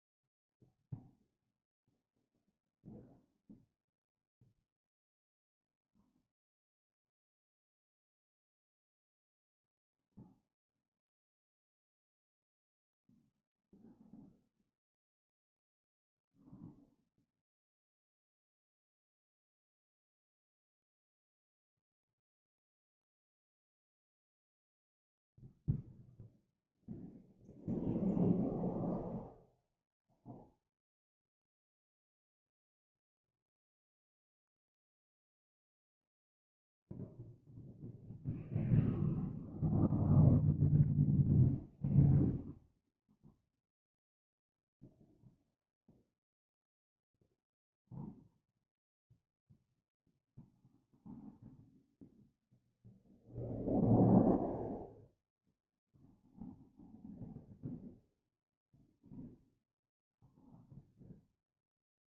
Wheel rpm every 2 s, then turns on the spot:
0, 0, 0, 0, 0, 0, 0, 0, 0, 0, 0, 0, 0, 0, 0, 0, 0, 0, 0, 0, 0, 0, 0, 0, 0, 0, 0, 0, 0, 0, 0.
none